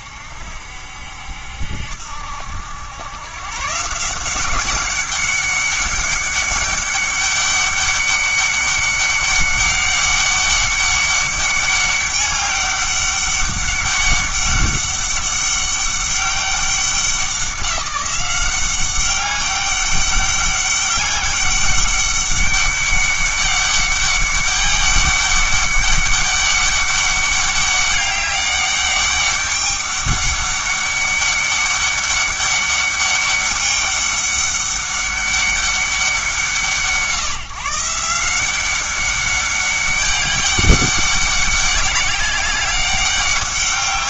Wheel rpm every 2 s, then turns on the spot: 70, 90, 190, 200, 200, 200, 200, 200, 200, 190, 200, 200, 200, 200, 200, 200, 200, 200, 170, 190, 200, 200.
none